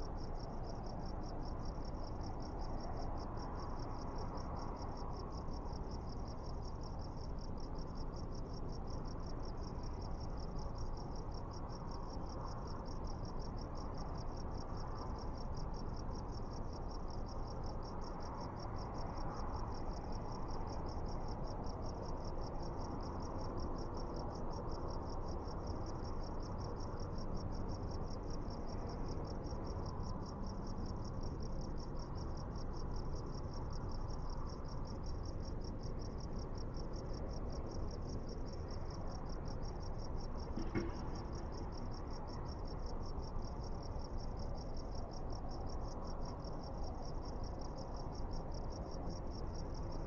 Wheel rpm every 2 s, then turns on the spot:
0, 0, 0, 0, 0, 0, 0, 0, 0, 0, 0, 0, 0, 0, 0, 0, 0, 0, 0, 0, 0, 0, 0, 0, 0.
none